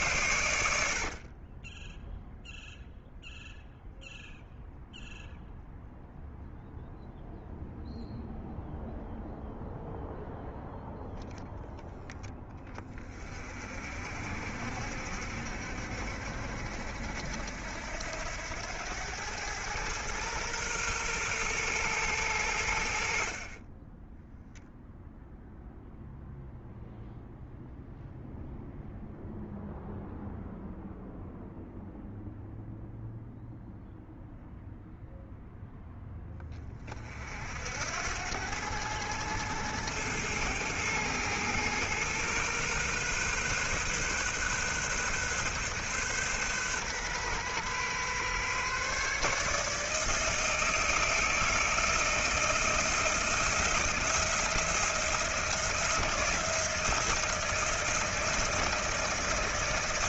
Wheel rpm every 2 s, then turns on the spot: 60, 0, 0, 0, 0, 0, 30, 60, 70, 100, 120, 60, 0, 0, 0, 0, 0, 0, 30, 100, 110, 130, 130, 130, 140, 160, 160, 170, 170, 160.
0-2